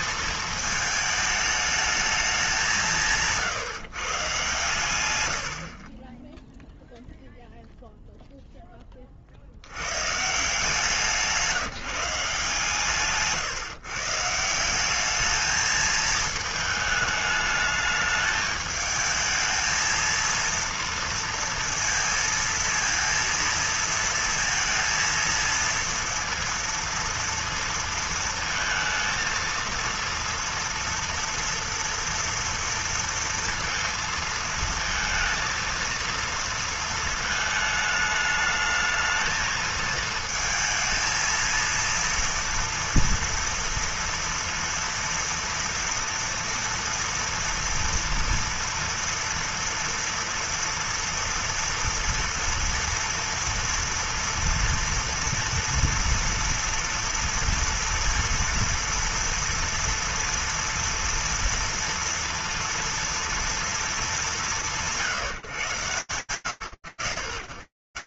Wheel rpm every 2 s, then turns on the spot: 220, 200, 130, 10, 0, 150, 160, 170, 220, 220, 230, 230, 230, 230, 220, 230, 230, 230, 230, 220, 220, 230, 230, 230, 230, 230, 230, 230, 230, 230, 230, 230, 180, 50.
none